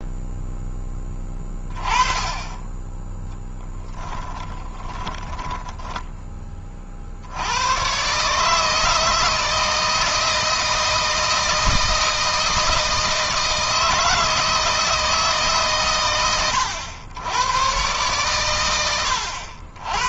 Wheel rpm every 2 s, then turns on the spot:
10, 20, 20, 30, 150, 160, 160, 160, 120, 110.
4-6